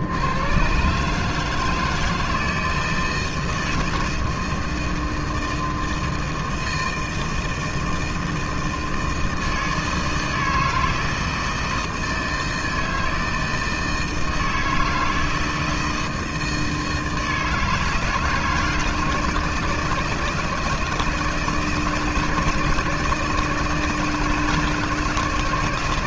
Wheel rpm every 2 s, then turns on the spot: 100, 160, 160, 160, 160, 160, 160, 160, 160, 160, 160, 160, 160.
none